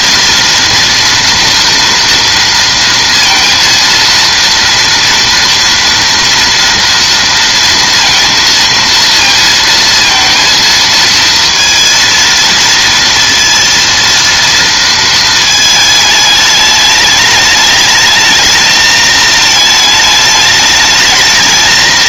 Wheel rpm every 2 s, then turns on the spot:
230, 230, 230, 230, 230, 230, 230, 230, 210, 220, 210.
none